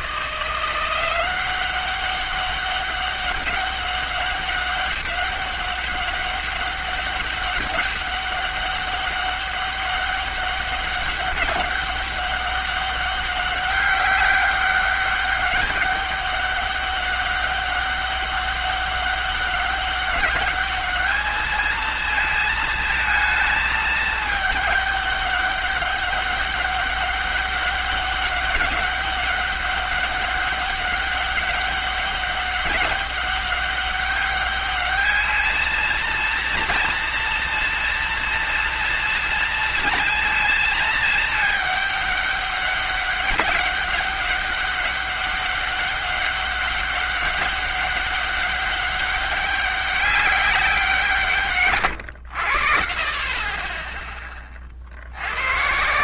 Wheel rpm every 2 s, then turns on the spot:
170, 190, 200, 200, 200, 200, 190, 200, 200, 200, 210, 220, 210, 200, 200, 200, 200, 200, 230, 230, 220, 200, 200, 200, 200, 200, 80, 30.
none